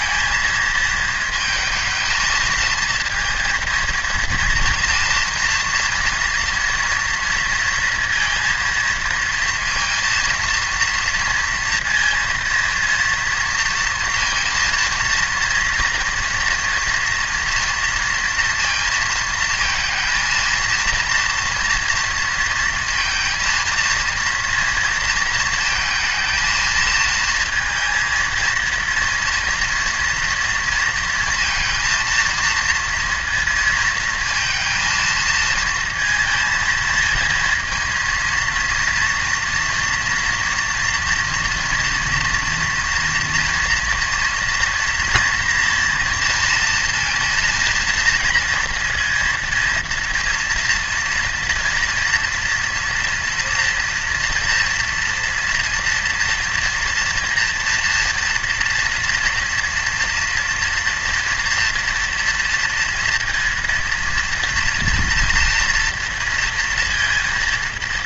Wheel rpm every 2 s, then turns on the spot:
220, 230, 240, 240, 230, 230, 230, 230, 230, 230, 230, 230, 230, 220, 230, 230, 230, 230, 220, 230, 230, 240, 230, 230, 230, 230, 230, 230, 230, 230, 230, 230, 230, 230.
none